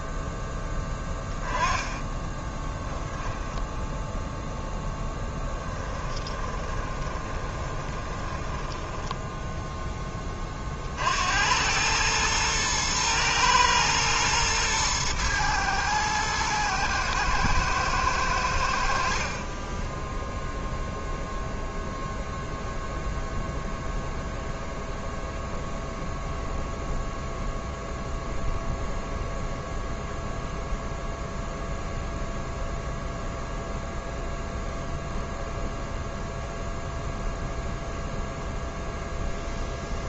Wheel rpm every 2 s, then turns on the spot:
10, 10, 10, 20, 10, 50, 110, 110, 110, 60, 0, 0, 0, 0, 0, 0, 0, 0, 0, 0.
0-4 6-10